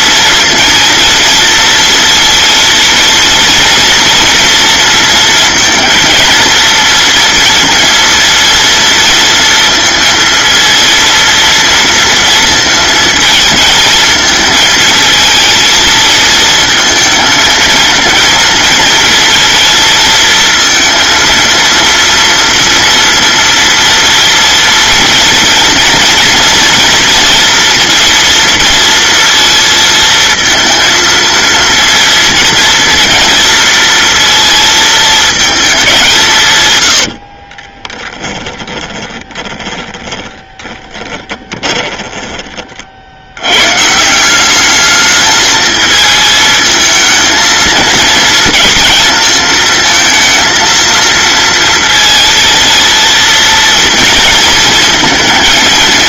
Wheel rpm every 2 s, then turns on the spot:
230, 230, 230, 230, 230, 230, 230, 220, 220, 230, 230, 230, 240, 230, 230, 230, 230, 220, 100, 20, 10, 50, 210, 220, 230, 230, 230, 220.
36-42